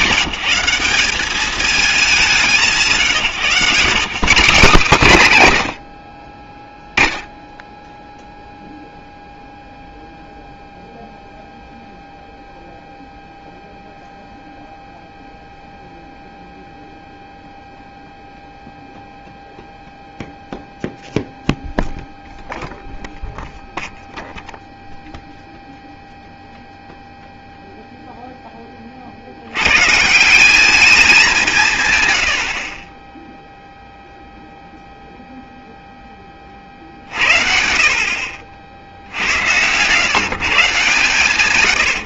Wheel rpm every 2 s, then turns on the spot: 170, 180, 190, 20, 0, 0, 0, 0, 0, 0, 0, 0, 0, 0, 20, 200, 50, 0, 40, 50, 150.
none